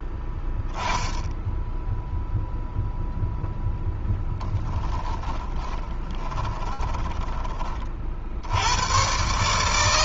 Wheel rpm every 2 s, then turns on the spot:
10, 0, 10, 20, 110.
4-8